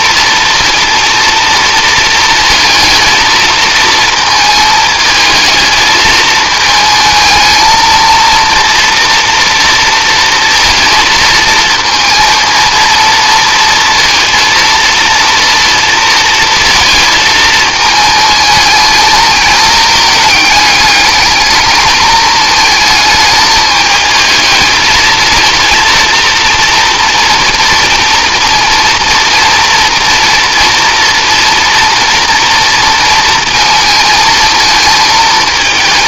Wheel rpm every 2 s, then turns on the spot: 230, 220, 220, 220, 230, 230, 230, 230, 230, 220, 220, 220, 220, 230, 230, 230, 230, 220.
none